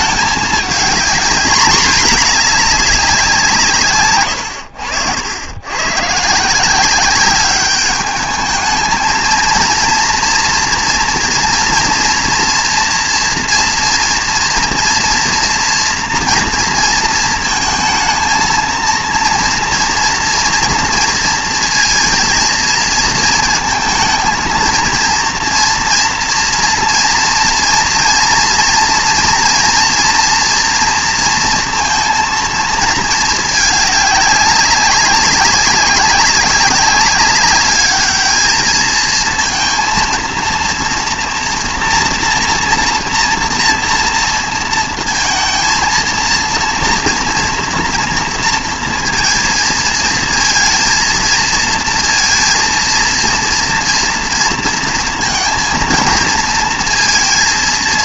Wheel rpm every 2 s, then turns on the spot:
210, 210, 90, 170, 210, 240, 230, 230, 230, 230, 230, 230, 230, 230, 230, 240, 230, 200, 200, 220, 230, 240, 230, 230, 230, 230, 230, 230, 230.
4-6